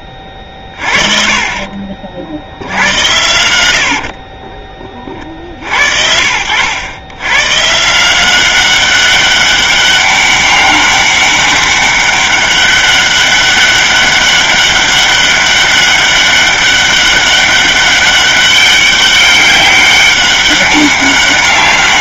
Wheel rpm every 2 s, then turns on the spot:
40, 100, 30, 100, 190, 200, 200, 200, 200, 200, 200.
none